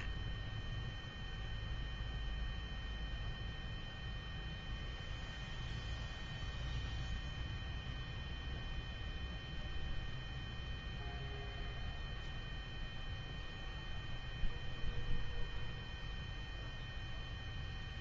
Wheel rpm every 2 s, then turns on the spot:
0, 0, 0, 0, 0, 0, 0, 0, 0.
none